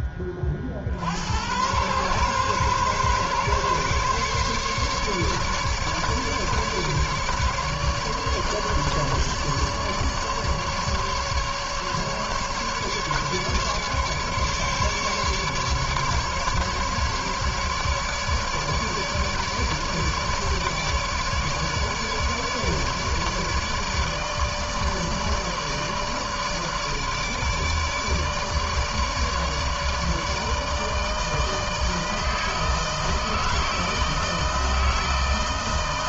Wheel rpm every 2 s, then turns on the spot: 40, 130, 140, 150, 150, 150, 150, 150, 140, 150, 150, 150, 150, 150, 150, 160, 160, 160.
none